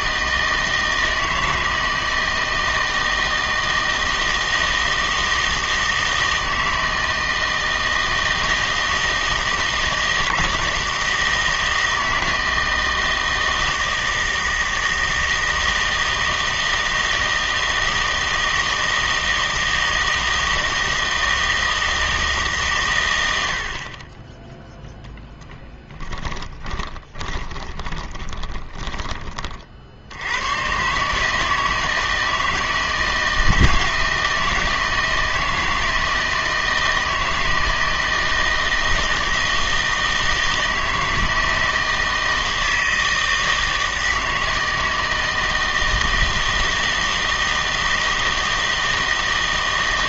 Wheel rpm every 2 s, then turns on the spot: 160, 160, 160, 160, 160, 160, 160, 160, 160, 160, 160, 130, 0, 10, 20, 120, 160, 160, 160, 160, 160, 160, 160, 160, 160.
26-30